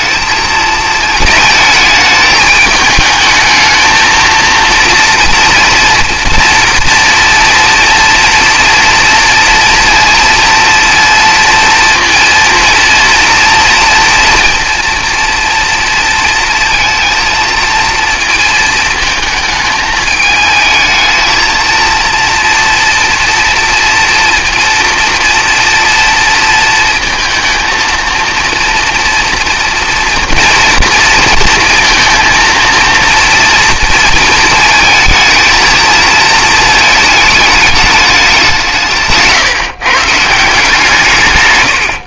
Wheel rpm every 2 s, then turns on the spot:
220, 220, 230, 230, 230, 230, 230, 230, 230, 230, 220, 230, 230, 230, 230, 230, 230, 220, 220, 160, 160.
none